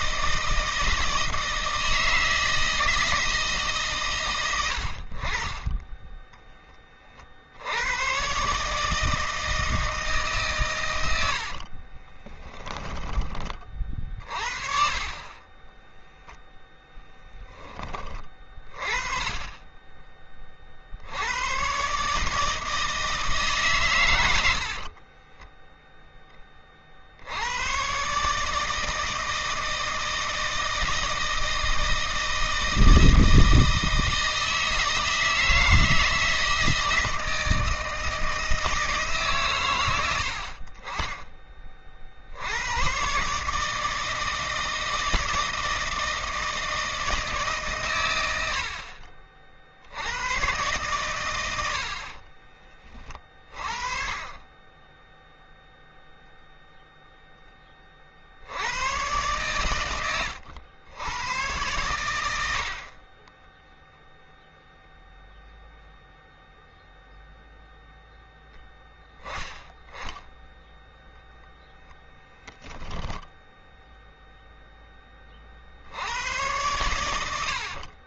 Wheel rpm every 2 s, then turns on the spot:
160, 160, 90, 20, 150, 130, 10, 40, 0, 30, 40, 160, 60, 30, 160, 160, 160, 160, 160, 160, 50, 100, 160, 160, 70, 130, 30, 10, 0, 90, 110, 60, 0, 0, 10, 0, 10, 10, 100.
24-26 72-74